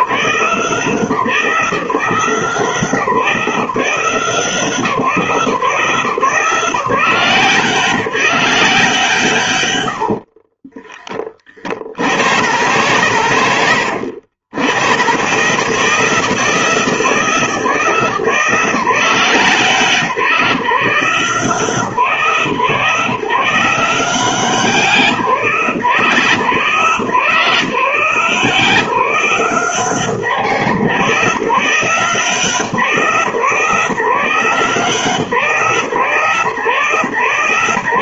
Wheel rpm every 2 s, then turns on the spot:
170, 170, 160, 160, 150, 20, 100, 120, 150, 160, 150, 150, 170, 140, 170, 160, 150, 160, 130.
none